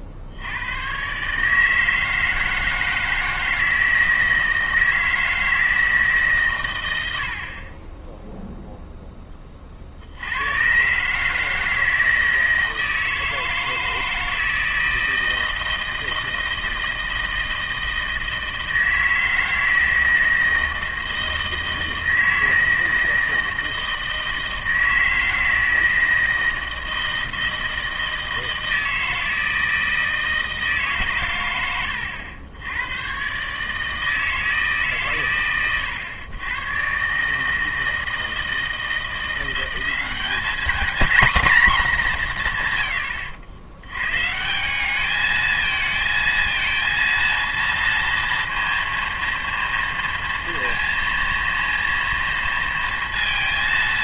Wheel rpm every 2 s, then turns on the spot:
100, 160, 160, 120, 0, 110, 160, 160, 160, 160, 160, 160, 160, 160, 160, 150, 100, 150, 120, 170, 230, 140, 190, 230, 230, 230, 230.
none